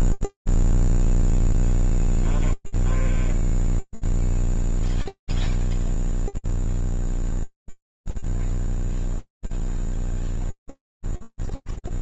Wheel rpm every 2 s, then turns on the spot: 0, 0, 0, 0, 0, 0.
none